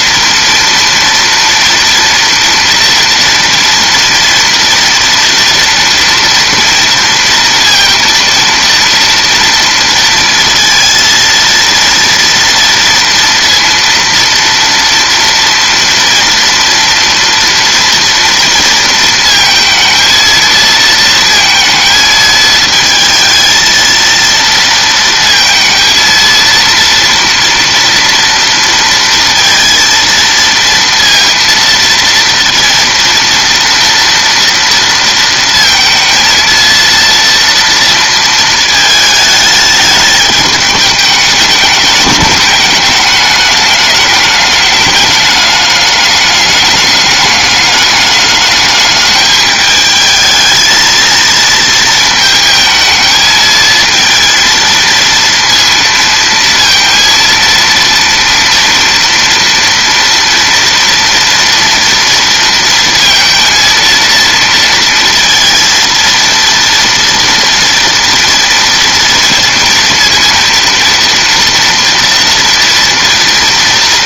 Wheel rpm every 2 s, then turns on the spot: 230, 230, 230, 230, 230, 230, 230, 230, 230, 230, 230, 220, 230, 230, 230, 230, 230, 230, 230, 220, 210, 210, 210, 200, 210, 220, 220, 230, 230, 240, 230, 230, 230, 230, 230, 230, 230.
none